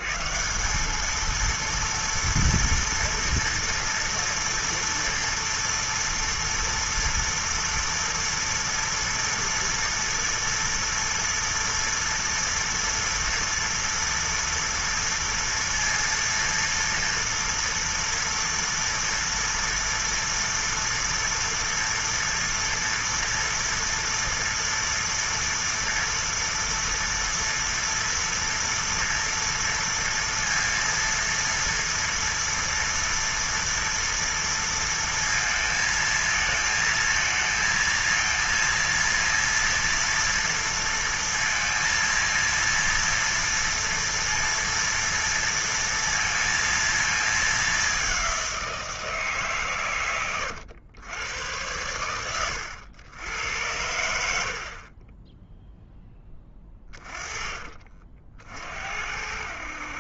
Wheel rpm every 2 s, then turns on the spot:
160, 230, 230, 230, 230, 230, 230, 230, 230, 230, 230, 230, 240, 230, 230, 230, 230, 230, 220, 230, 230, 230, 230, 230, 200, 110, 110, 80, 10, 40.
none